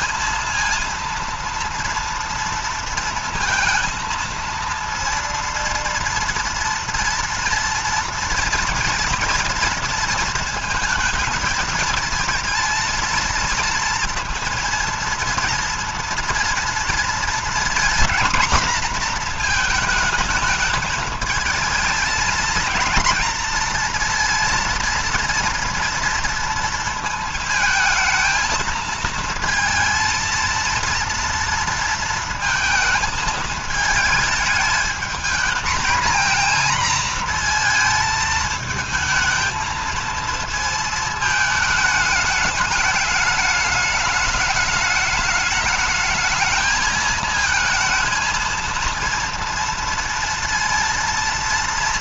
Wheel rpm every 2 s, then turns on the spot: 230, 230, 230, 230, 230, 220, 230, 230, 230, 240, 220, 220, 230, 230, 220, 230, 230, 220, 230, 220, 220, 210, 210, 220, 230, 230.
none